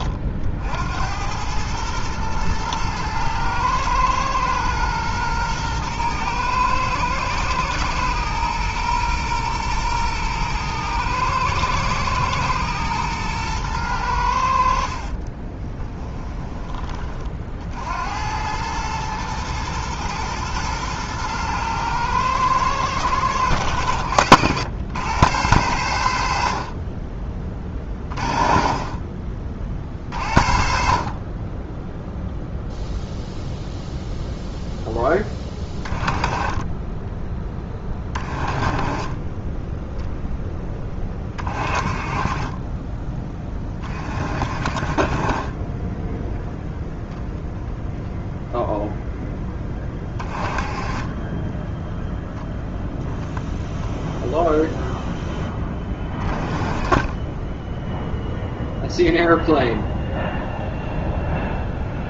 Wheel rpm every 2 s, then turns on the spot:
80, 110, 120, 110, 120, 120, 110, 50, 30, 110, 110, 110, 100, 30, 40, 50, 0, 10, 20, 30, 20, 20, 30, 0, 0, 20, 0, 0, 20, 0, 0.
14-16